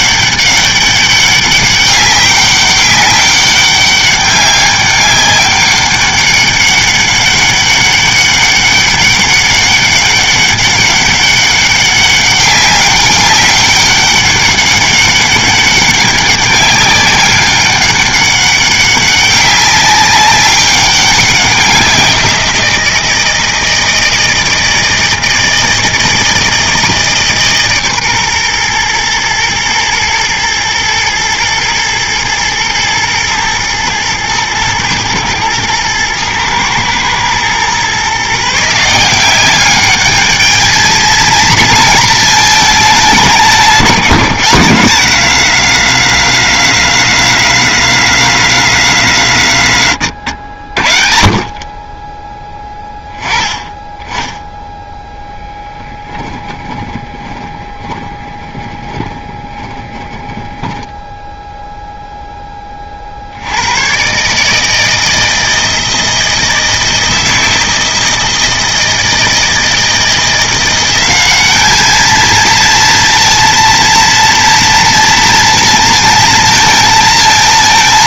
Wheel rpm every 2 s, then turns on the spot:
200, 200, 200, 200, 200, 200, 200, 200, 200, 190, 200, 170, 160, 160, 120, 110, 110, 110, 110, 160, 220, 220, 170, 180, 170, 70, 10, 10, 10, 20, 10, 20, 150, 160, 160, 180, 230, 230, 230.
54-62